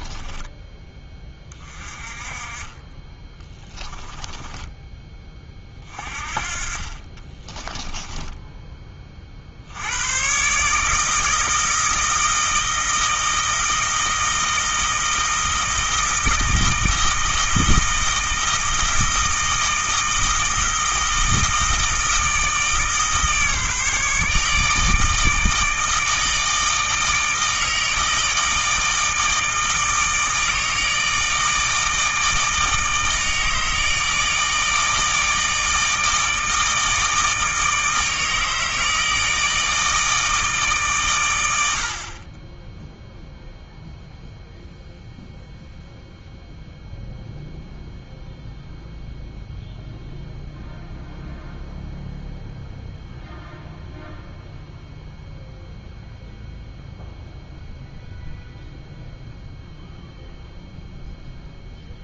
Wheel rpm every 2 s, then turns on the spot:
10, 20, 10, 30, 20, 150, 160, 160, 160, 160, 160, 150, 150, 160, 160, 160, 160, 160, 160, 160, 140, 0, 0, 0, 0, 0, 0, 0, 0, 0, 0.
none